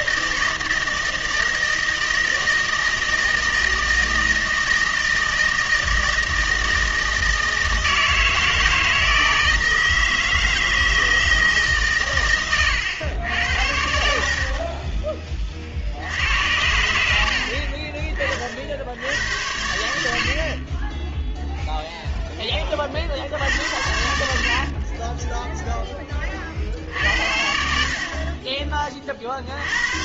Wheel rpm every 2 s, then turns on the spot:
160, 160, 160, 160, 160, 160, 110, 30, 90, 70, 30, 30, 40, 60, 30.
24-26